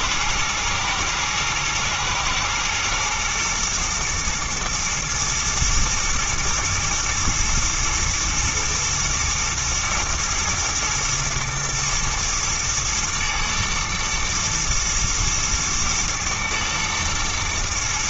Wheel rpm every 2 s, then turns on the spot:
110, 120, 110, 110, 110, 110, 120, 110, 110.
none